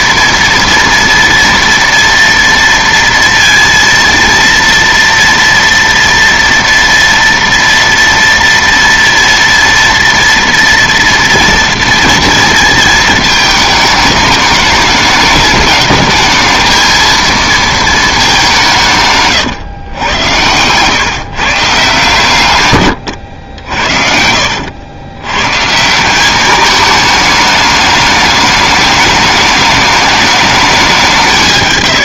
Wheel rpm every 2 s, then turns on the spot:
230, 230, 230, 230, 230, 230, 230, 210, 220, 170, 110, 120, 80, 210, 210, 200.
none